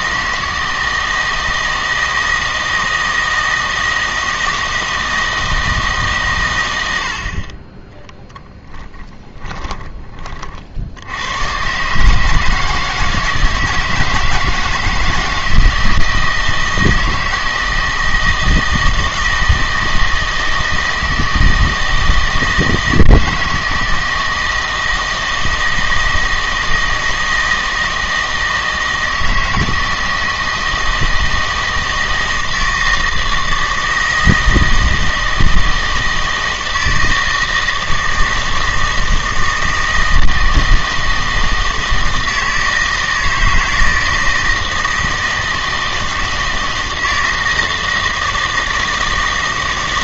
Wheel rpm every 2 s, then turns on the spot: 160, 160, 160, 90, 20, 60, 160, 160, 160, 160, 160, 160, 160, 160, 160, 160, 160, 160, 160, 160, 160, 160, 160, 160, 160.
8-10